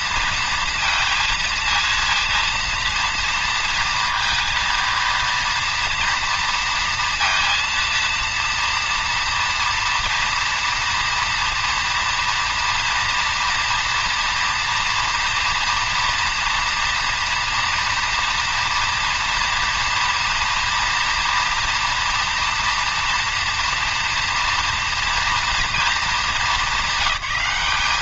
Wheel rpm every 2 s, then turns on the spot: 230, 230, 230, 230, 230, 240, 230, 230, 230, 230, 230, 230, 240, 200.
none